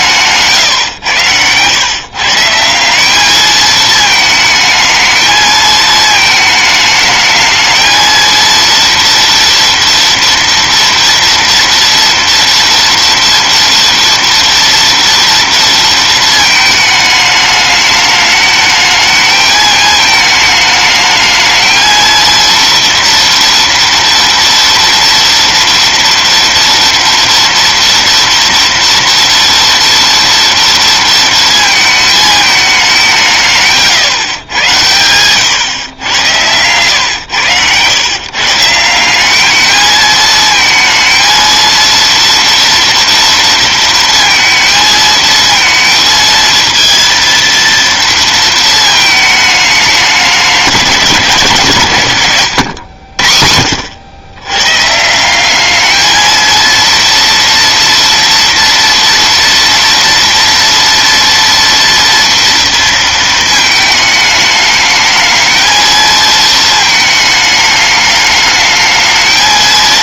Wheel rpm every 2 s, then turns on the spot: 120, 190, 220, 220, 230, 230, 230, 230, 220, 220, 210, 230, 230, 230, 230, 230, 200, 100, 110, 180, 230, 230, 220, 230, 220, 170, 80, 150, 230, 230, 230, 230, 210, 220, 220.
none